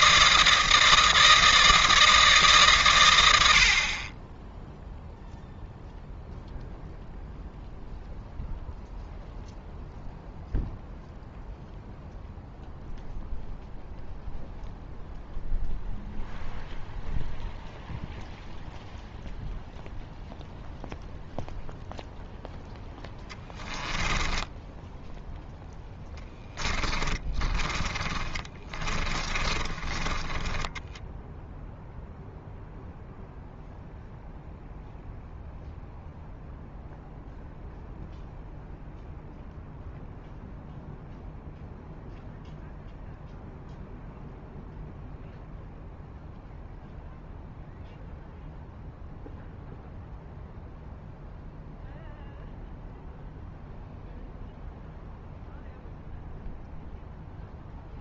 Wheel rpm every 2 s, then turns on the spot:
160, 120, 0, 0, 0, 0, 0, 0, 0, 0, 0, 0, 0, 10, 20, 20, 0, 0, 0, 0, 0, 0, 0, 0, 0, 0, 0, 0, 0.
26-32